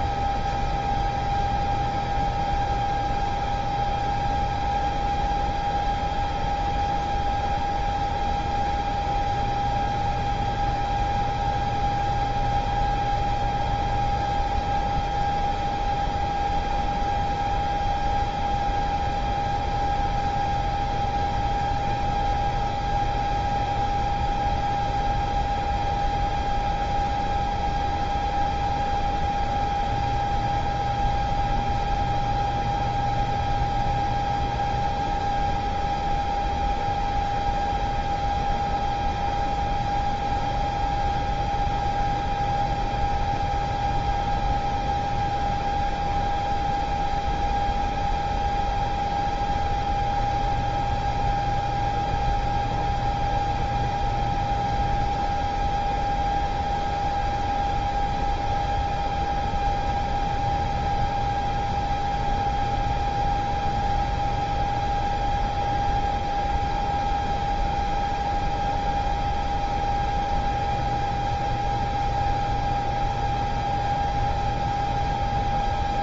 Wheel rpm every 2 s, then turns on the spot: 0, 0, 0, 0, 0, 0, 0, 0, 0, 0, 0, 0, 0, 0, 0, 0, 0, 0, 0, 0, 0, 0, 0, 0, 0, 0, 0, 0, 0, 0, 0, 0, 0, 0, 0, 0, 0, 0.
none